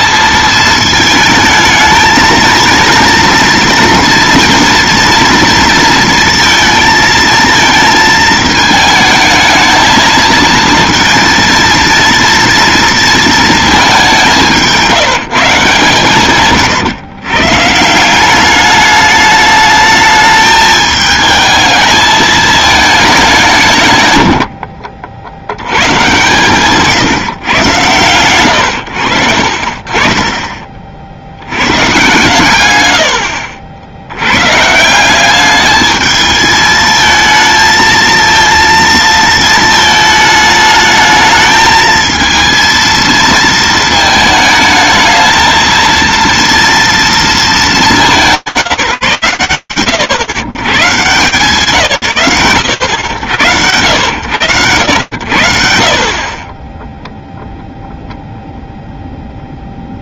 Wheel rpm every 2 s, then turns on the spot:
220, 230, 230, 230, 220, 230, 230, 170, 120, 200, 220, 220, 60, 140, 110, 30, 120, 120, 220, 230, 220, 230, 220, 230, 110, 130, 80, 60, 0, 0.
none